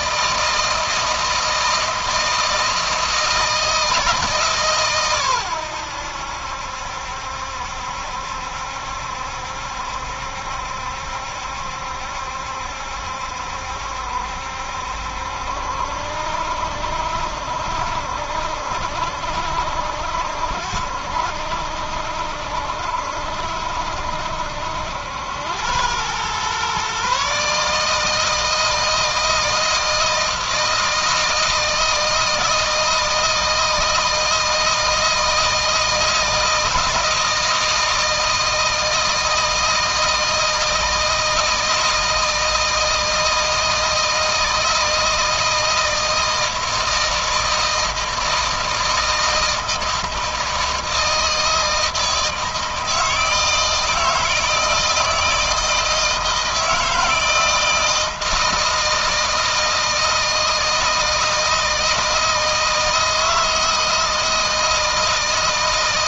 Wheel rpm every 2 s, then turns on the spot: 160, 160, 140, 70, 70, 70, 70, 70, 70, 70, 70, 70, 80, 130, 160, 160, 160, 160, 160, 160, 160, 160, 160, 160, 160, 160, 160, 160, 160, 160, 160, 160, 160.
none